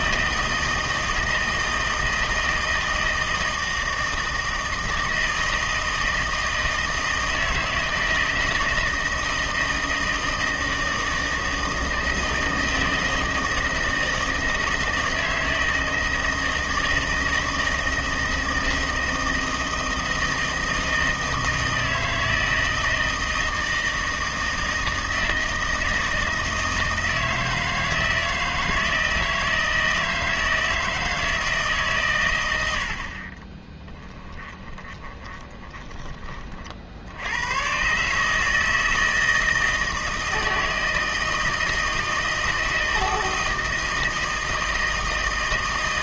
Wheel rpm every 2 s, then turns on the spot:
160, 160, 160, 160, 160, 160, 160, 160, 160, 160, 160, 160, 160, 160, 160, 160, 70, 20, 60, 160, 160, 160, 160.
34-36